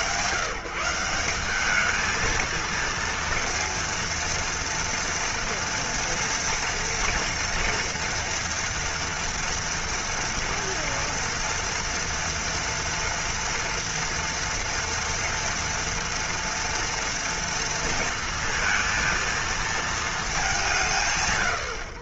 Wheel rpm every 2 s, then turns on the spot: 170, 230, 230, 230, 230, 230, 230, 230, 230, 230, 160.
none